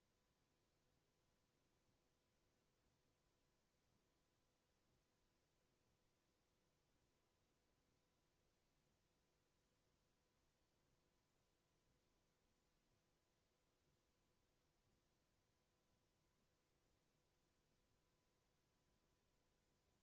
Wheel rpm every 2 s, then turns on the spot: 0, 0, 0, 0, 0, 0, 0, 0, 0, 0.
none